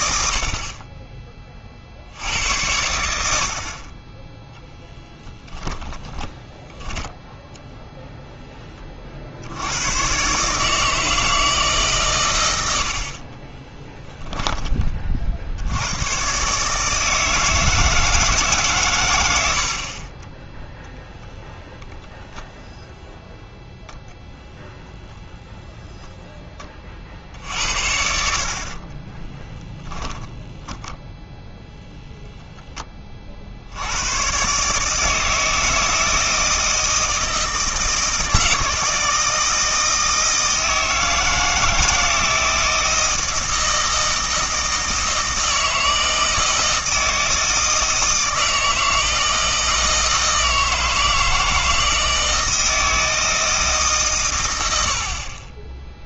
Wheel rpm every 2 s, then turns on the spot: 60, 90, 10, 10, 10, 150, 100, 10, 140, 140, 10, 0, 0, 20, 40, 10, 10, 140, 160, 160, 160, 160, 160, 160, 160, 160, 160, 100.
6-8 28-32